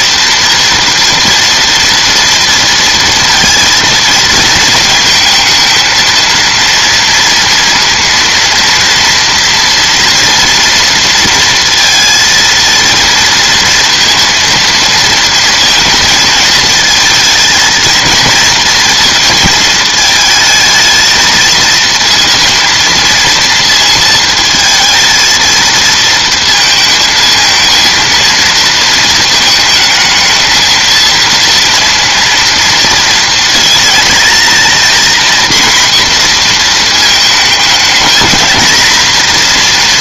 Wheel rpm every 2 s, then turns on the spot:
230, 230, 220, 230, 230, 230, 230, 230, 220, 230, 220, 230, 220, 230, 230, 220, 230, 230, 230, 220.
none